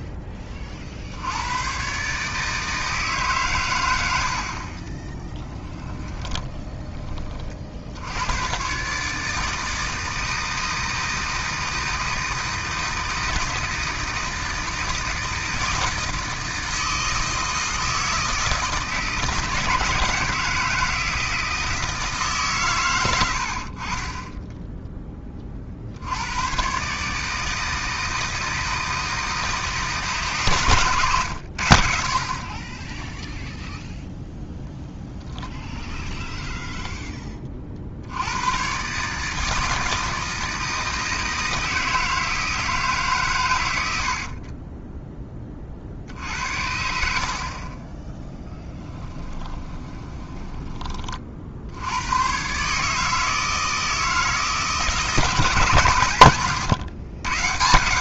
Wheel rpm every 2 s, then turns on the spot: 30, 160, 30, 20, 140, 160, 160, 160, 160, 160, 160, 110, 10, 130, 160, 120, 10, 10, 10, 120, 160, 150, 20, 60, 10, 30, 150, 160, 120.
4-6 34-38 44-46 48-50